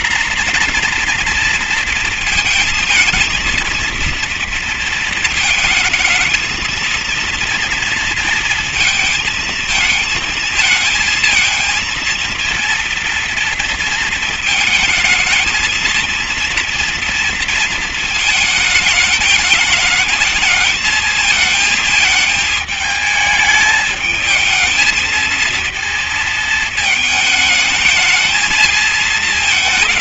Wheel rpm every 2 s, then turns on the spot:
250, 230, 230, 220, 230, 220, 230, 220, 230, 220, 220, 220, 220, 220, 220.
none